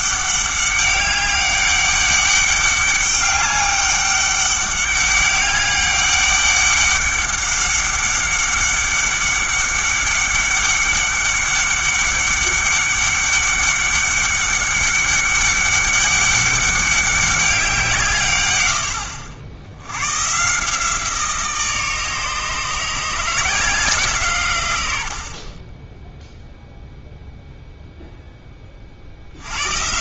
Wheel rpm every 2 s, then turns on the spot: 200, 200, 200, 200, 200, 190, 200, 200, 200, 100, 160, 160, 110, 0, 30.
none